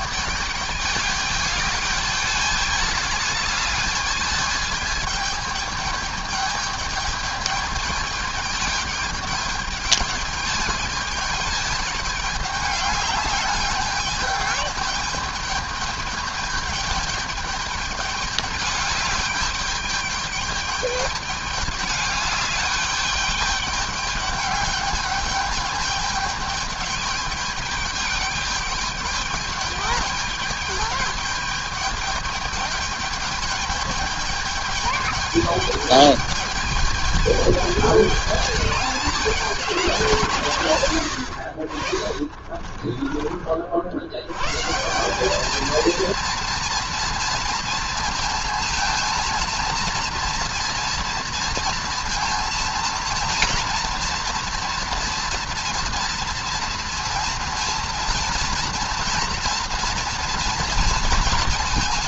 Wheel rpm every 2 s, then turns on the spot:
210, 210, 210, 210, 210, 210, 210, 210, 210, 210, 210, 210, 210, 210, 210, 210, 210, 210, 210, 210, 150, 40, 120, 230, 230, 230, 230, 230, 230, 230, 240.
42-44